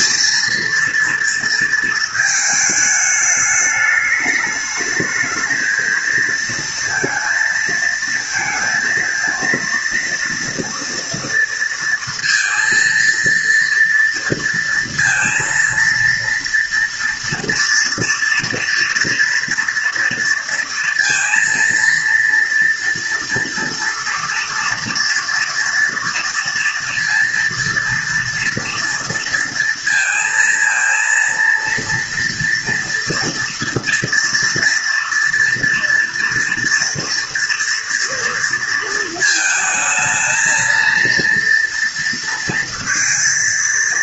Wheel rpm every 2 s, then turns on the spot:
230, 210, 210, 230, 230, 230, 230, 230, 230, 230, 230, 230, 230, 230, 230, 230, 230, 240, 240, 230, 230, 230.
none